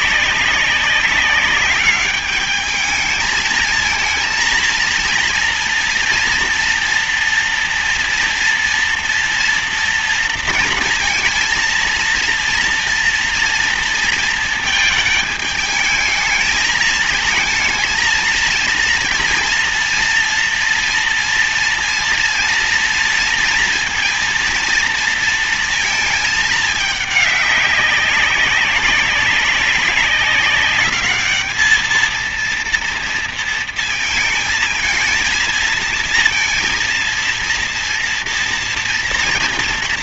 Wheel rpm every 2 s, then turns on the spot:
200, 210, 220, 230, 230, 230, 230, 220, 220, 230, 230, 230, 230, 220, 200, 200, 230, 220, 230, 230.
none